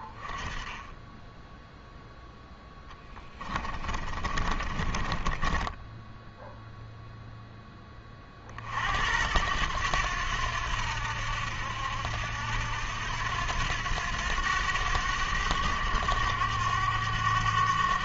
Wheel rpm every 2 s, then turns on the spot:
10, 10, 20, 0, 60, 80, 80, 90, 100.
2-6